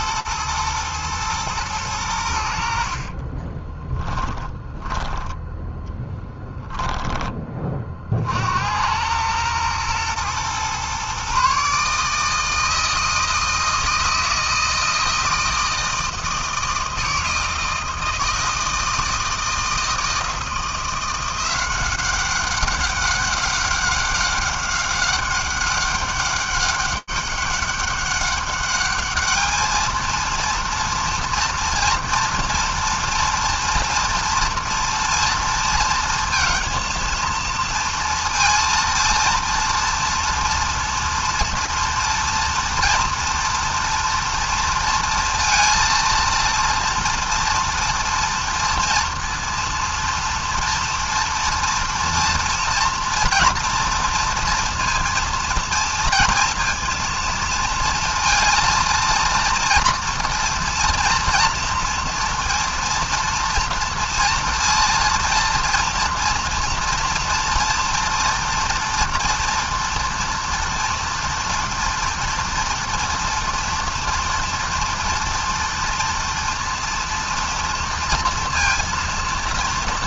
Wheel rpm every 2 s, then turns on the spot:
120, 80, 20, 10, 70, 120, 160, 160, 160, 160, 160, 200, 190, 200, 200, 230, 230, 230, 230, 230, 230, 230, 230, 230, 230, 230, 230, 230, 230, 230, 230, 230, 230, 240, 240, 230, 230, 230, 230, 230.
4-8